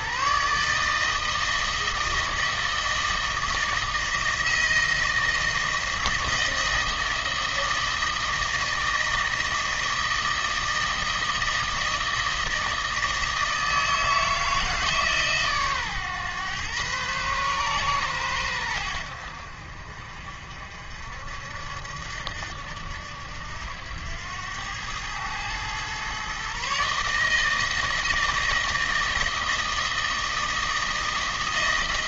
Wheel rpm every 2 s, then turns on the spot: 150, 160, 160, 160, 160, 160, 160, 160, 120, 100, 60, 80, 100, 140, 160, 160.
none